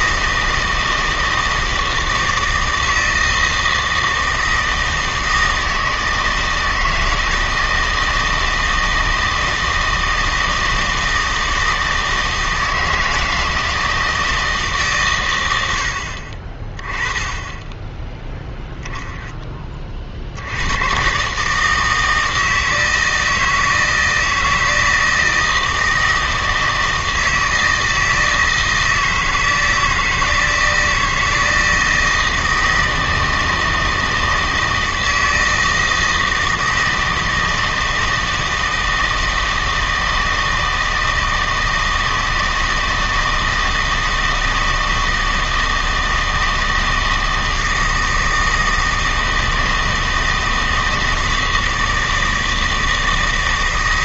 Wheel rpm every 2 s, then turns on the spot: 160, 160, 160, 160, 160, 160, 160, 150, 20, 0, 100, 160, 160, 160, 160, 160, 160, 160, 160, 160, 160, 160, 160, 160, 160, 160, 160.
none